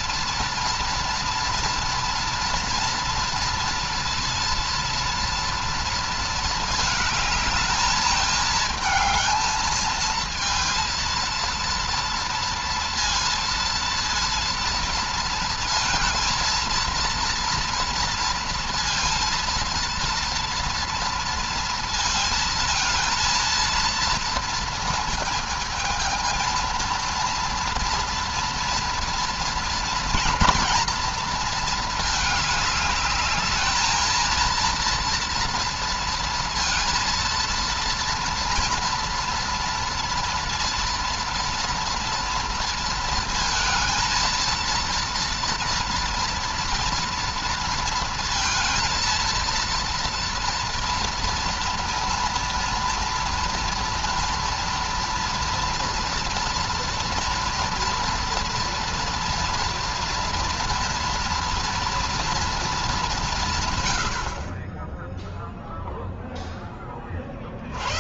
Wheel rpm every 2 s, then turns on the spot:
230, 230, 230, 220, 220, 230, 230, 230, 230, 230, 230, 230, 230, 230, 230, 230, 210, 220, 230, 230, 230, 230, 230, 230, 230, 230, 240, 230, 230, 230, 230, 230, 50, 10.
none